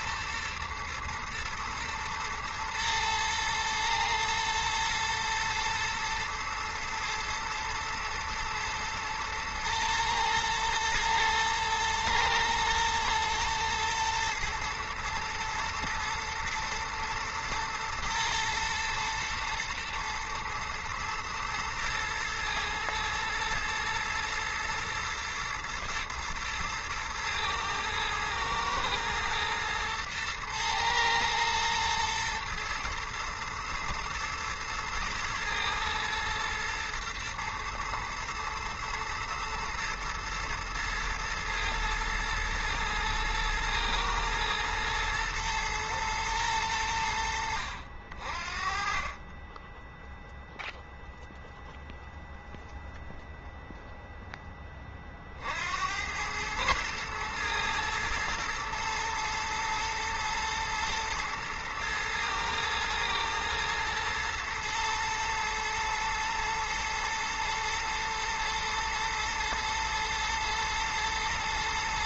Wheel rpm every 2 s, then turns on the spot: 120, 120, 110, 120, 110, 110, 110, 110, 120, 120, 120, 120, 110, 110, 110, 110, 110, 110, 110, 110, 110, 110, 110, 90, 30, 0, 0, 30, 110, 110, 110, 110, 110, 120, 120, 120.
none